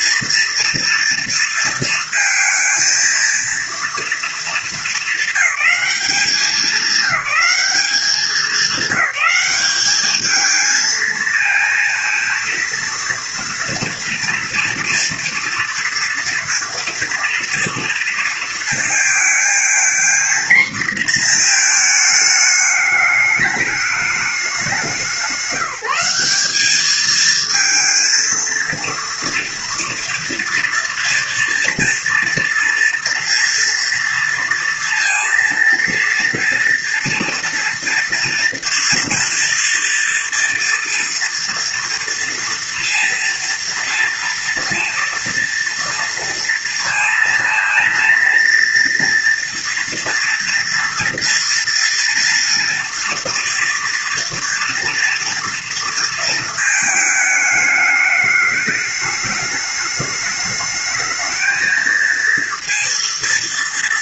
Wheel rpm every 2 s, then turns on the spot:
240, 230, 210, 190, 200, 220, 230, 230, 230, 230, 240, 210, 200, 210, 230, 230, 230, 230, 230, 230, 230, 230, 230, 230, 230, 230, 240, 230, 220, 210, 210, 230.
none